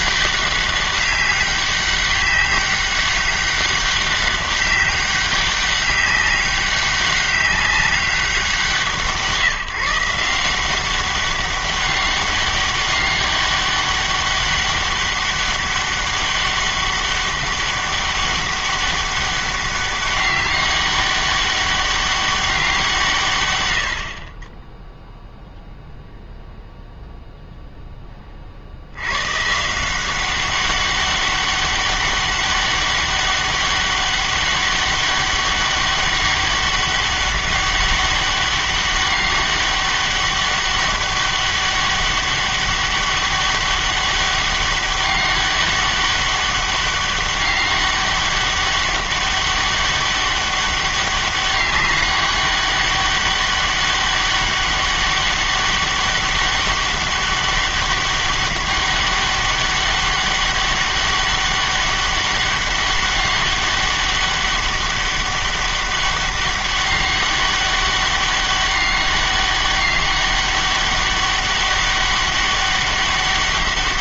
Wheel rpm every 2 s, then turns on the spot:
200, 200, 200, 200, 170, 180, 200, 200, 200, 200, 190, 180, 10, 0, 60, 190, 200, 200, 200, 200, 200, 200, 200, 200, 200, 200, 200, 200, 200, 200, 200, 200, 200, 200, 200, 200, 200.
none